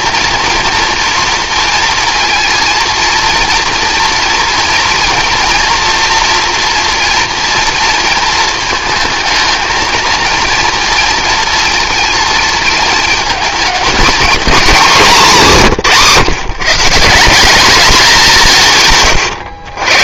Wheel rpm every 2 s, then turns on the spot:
240, 230, 230, 230, 220, 230, 220, 230, 150, 160.
none